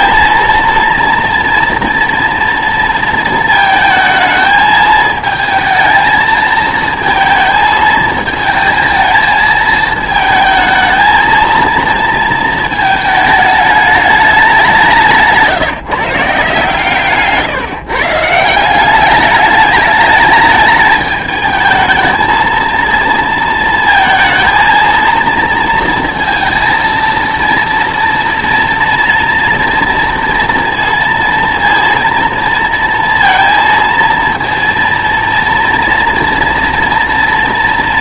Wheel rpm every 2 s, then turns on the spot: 230, 230, 220, 220, 220, 220, 220, 190, 140, 180, 220, 230, 230, 230, 230, 230, 230, 230, 230.
none